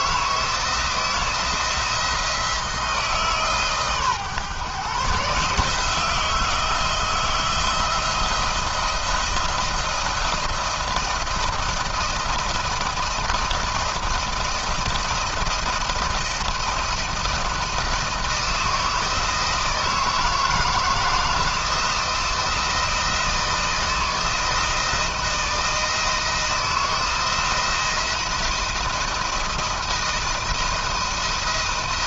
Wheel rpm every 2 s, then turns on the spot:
160, 160, 140, 160, 170, 170, 170, 170, 170, 160, 160, 170, 160, 160, 170, 160.
none